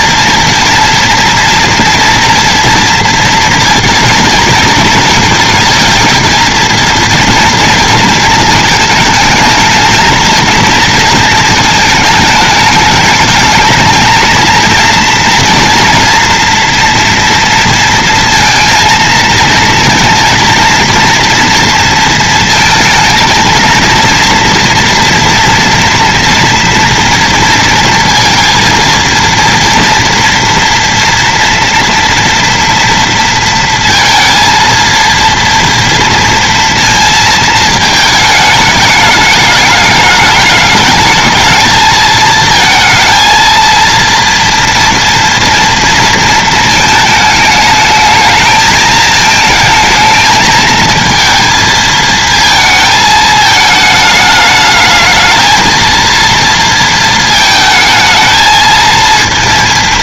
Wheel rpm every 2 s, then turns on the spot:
230, 230, 230, 230, 220, 230, 210, 230, 240, 230, 230, 230, 230, 230, 230, 240, 230, 230, 230, 210, 210, 220, 230, 220, 220, 220, 220, 210, 230, 220.
none